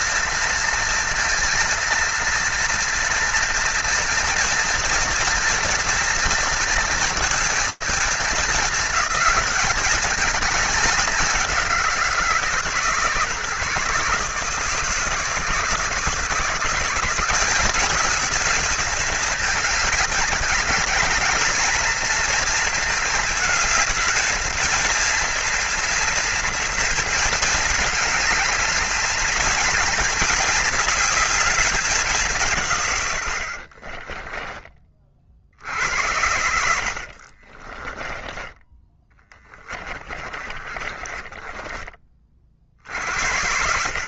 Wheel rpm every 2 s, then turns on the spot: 230, 230, 240, 230, 220, 210, 140, 160, 180, 220, 210, 220, 230, 230, 220, 220, 90, 40, 60, 10, 20, 60.
36-42